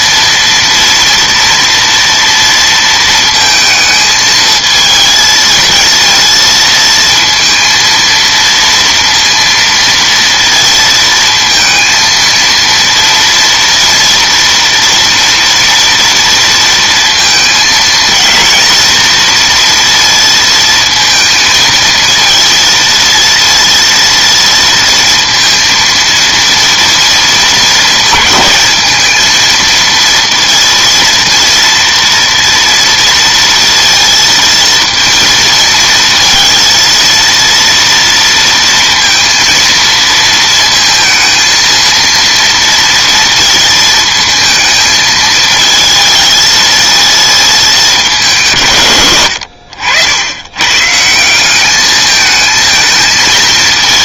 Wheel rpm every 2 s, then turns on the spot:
230, 230, 220, 230, 230, 230, 230, 230, 230, 230, 230, 230, 230, 230, 220, 230, 230, 230, 230, 230, 230, 230, 220, 220, 150, 120, 220.
none